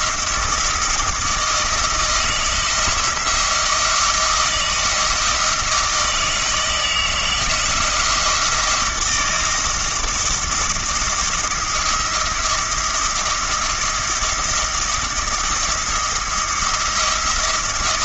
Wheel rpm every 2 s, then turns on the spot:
160, 170, 170, 160, 160, 160, 170, 170, 170.
none